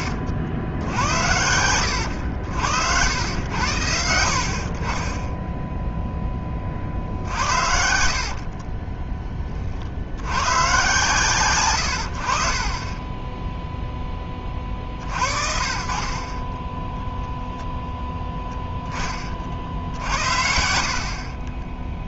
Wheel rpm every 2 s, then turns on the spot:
70, 80, 50, 30, 20, 120, 30, 40, 10, 10, 60.
8-10 20-22